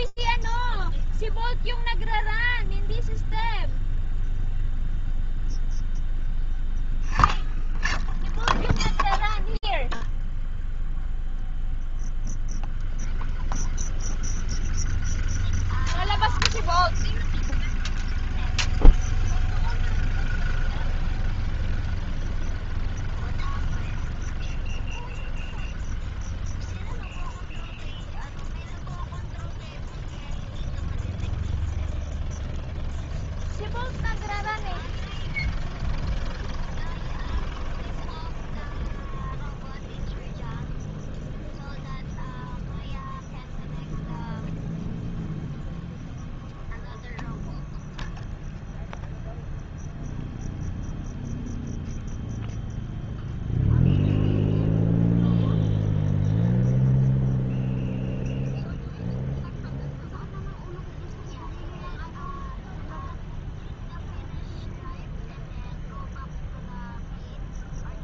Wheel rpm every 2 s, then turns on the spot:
0, 0, 0, 10, 0, 0, 0, 0, 0, 0, 0, 0, 0, 0, 0, 0, 0, 0, 0, 0, 0, 0, 0, 0, 0, 0, 0, 0, 0, 0, 0, 0, 0, 0.
none